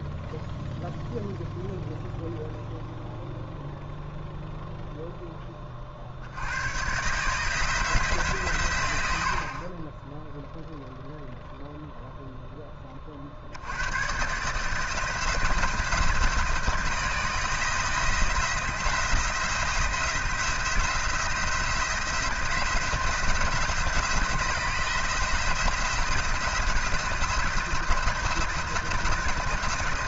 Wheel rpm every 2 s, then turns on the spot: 0, 0, 0, 110, 100, 0, 20, 160, 170, 170, 170, 170, 170, 170, 170.
none